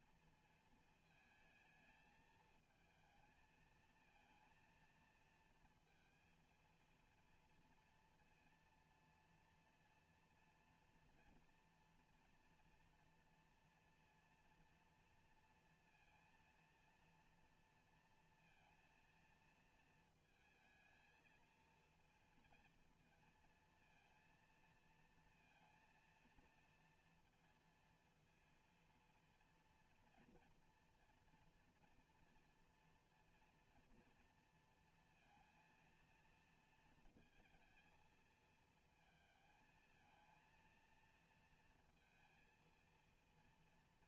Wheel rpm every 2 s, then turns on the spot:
220, 220, 230, 230, 230, 230, 230, 230, 230, 230, 220, 230, 230, 230, 230, 240, 230, 230, 230, 220, 230, 230.
none